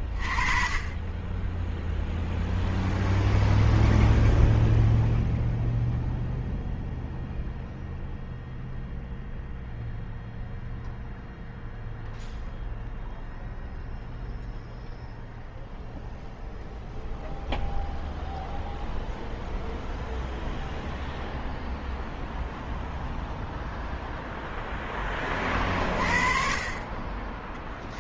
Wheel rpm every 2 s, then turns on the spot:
30, 0, 0, 0, 0, 0, 0, 0, 0, 0, 0, 0, 0, 30.
none